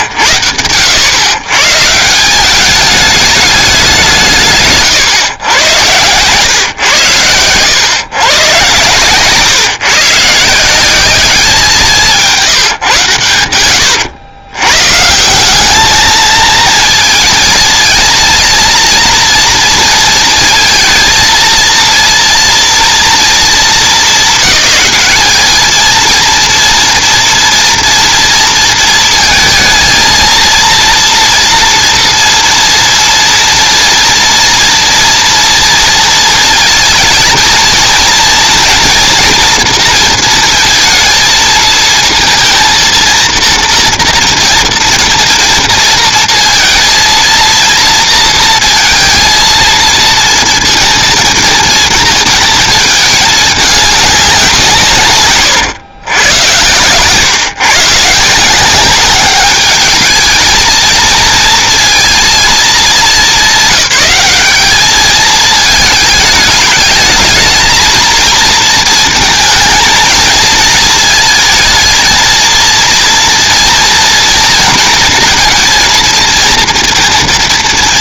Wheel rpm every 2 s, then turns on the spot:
120, 200, 110, 110, 160, 190, 100, 200, 230, 230, 230, 230, 210, 240, 230, 230, 230, 230, 230, 230, 230, 230, 230, 230, 230, 230, 210, 130, 140, 200, 230, 200, 220, 220, 220, 220, 230, 230, 230.
none